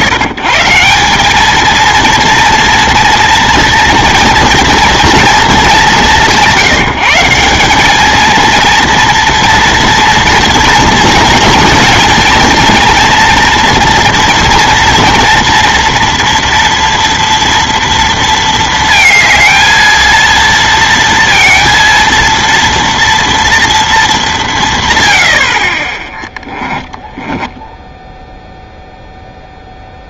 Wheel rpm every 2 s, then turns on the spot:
140, 230, 230, 170, 230, 240, 240, 230, 230, 230, 230, 230, 170, 10, 0.
26-28